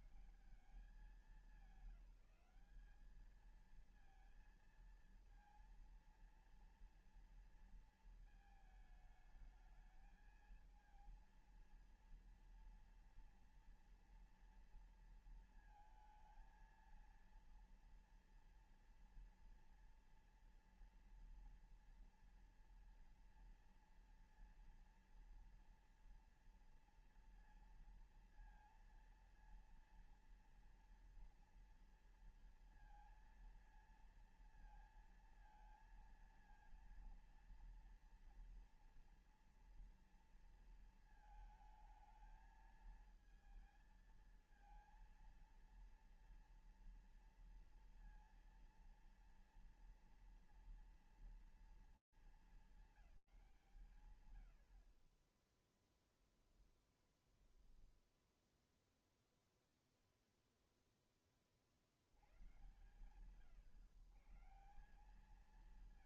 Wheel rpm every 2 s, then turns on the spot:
170, 210, 230, 230, 220, 220, 230, 230, 230, 240, 240, 230, 230, 230, 230, 230, 230, 230, 230, 240, 230, 220, 230, 230, 230, 230, 200, 60, 10, 10, 10, 120, 170.
none